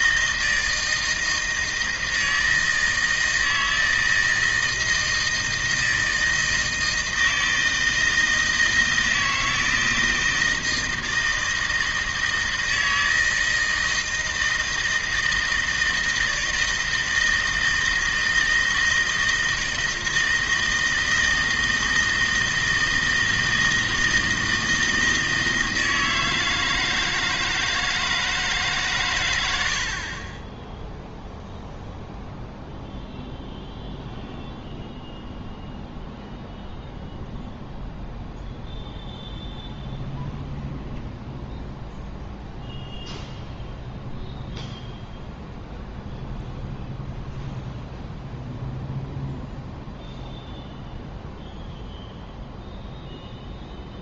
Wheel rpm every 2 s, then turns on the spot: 160, 160, 160, 160, 160, 160, 160, 160, 160, 160, 160, 160, 160, 160, 140, 10, 0, 0, 0, 0, 0, 0, 0, 0, 0, 0, 0.
none